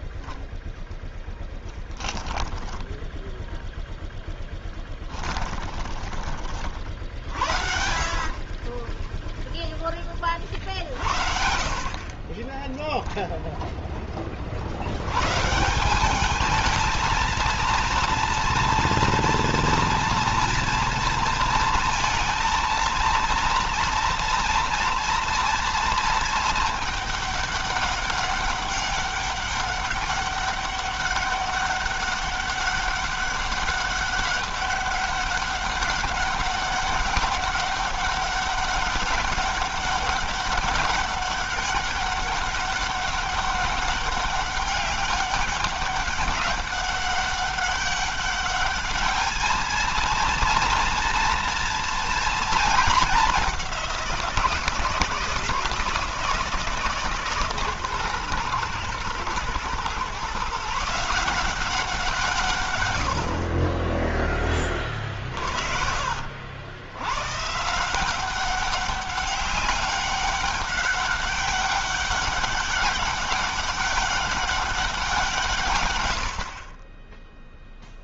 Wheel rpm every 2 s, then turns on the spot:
0, 10, 10, 50, 30, 50, 10, 70, 220, 230, 230, 230, 230, 220, 200, 200, 200, 200, 200, 200, 200, 200, 200, 200, 210, 230, 220, 170, 160, 120, 150, 100, 30, 90, 190, 200, 200, 190, 40.
4-6 8-10 12-14 64-66